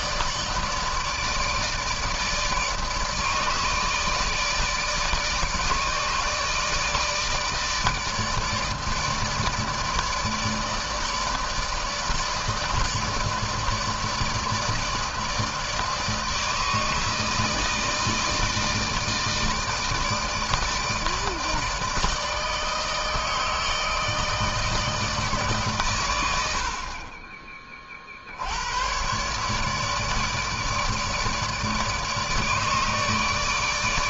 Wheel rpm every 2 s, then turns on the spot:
150, 150, 160, 160, 150, 160, 150, 160, 160, 160, 160, 160, 160, 80, 80, 150, 150.
none